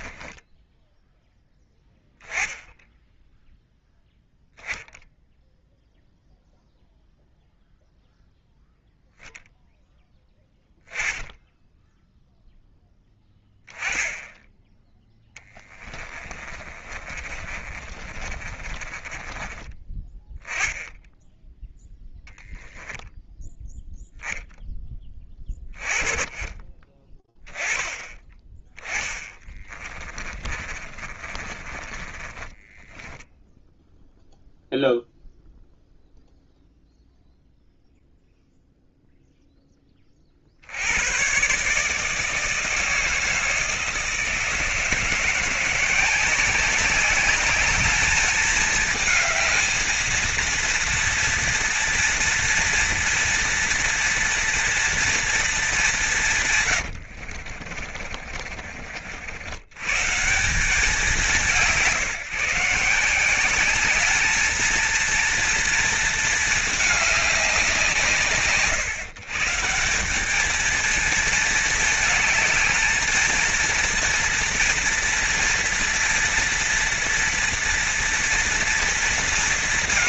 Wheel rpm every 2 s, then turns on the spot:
10, 10, 0, 0, 0, 10, 0, 10, 30, 30, 10, 10, 10, 20, 20, 20, 20, 0, 0, 0, 40, 150, 160, 180, 210, 230, 240, 240, 170, 50, 120, 160, 220, 230, 130, 200, 220, 230, 230, 230.
16-20 30-34 58-60